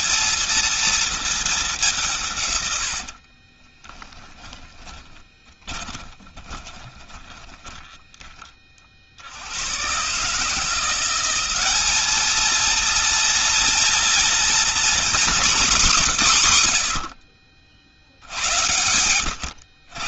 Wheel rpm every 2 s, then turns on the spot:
230, 140, 10, 20, 40, 170, 220, 240, 140, 80.
4-8